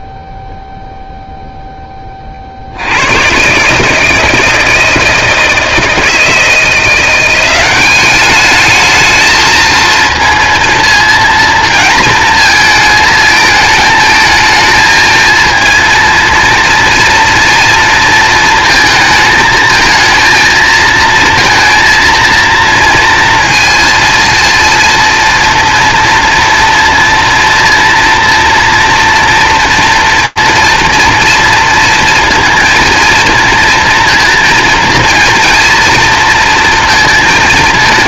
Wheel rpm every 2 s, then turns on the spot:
0, 50, 160, 170, 210, 230, 230, 220, 230, 230, 220, 230, 230, 230, 230, 230, 230, 230, 230.
none